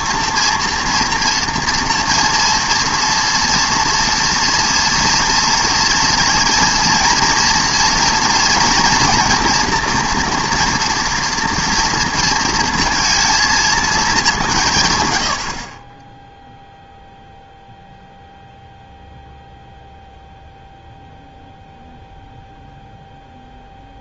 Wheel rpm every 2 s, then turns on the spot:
230, 230, 230, 240, 240, 240, 230, 170, 0, 0, 0, 0.
none